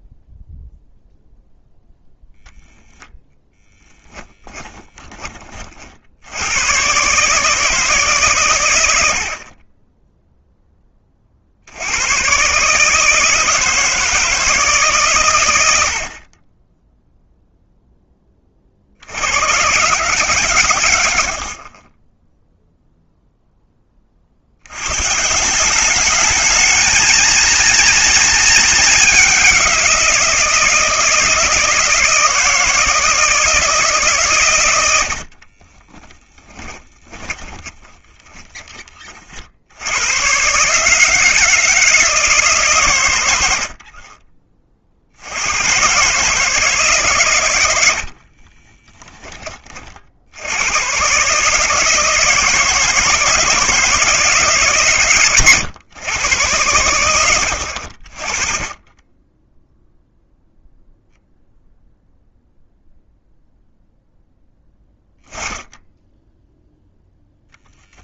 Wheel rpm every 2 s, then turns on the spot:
0, 10, 10, 100, 110, 10, 140, 150, 20, 40, 120, 0, 90, 210, 210, 170, 160, 100, 10, 20, 140, 140, 40, 160, 30, 90, 160, 150, 110, 30, 0, 0, 10, 0.
4-6 36-38 48-50